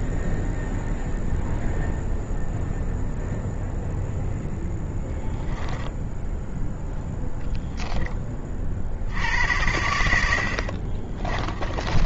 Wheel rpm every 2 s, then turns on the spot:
0, 0, 0, 0, 50, 60.
10-12